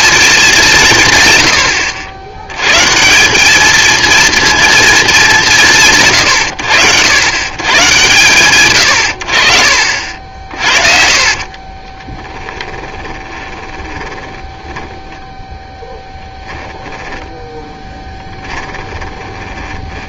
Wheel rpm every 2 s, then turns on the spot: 190, 120, 230, 100, 110, 50, 10, 10, 10, 20.
12-20